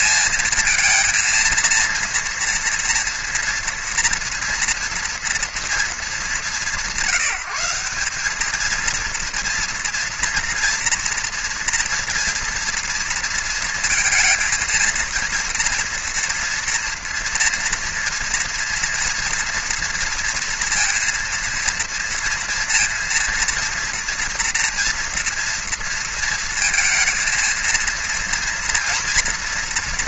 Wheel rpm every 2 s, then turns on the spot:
230, 240, 230, 190, 210, 230, 230, 230, 230, 230, 230, 230, 230, 230, 230.
none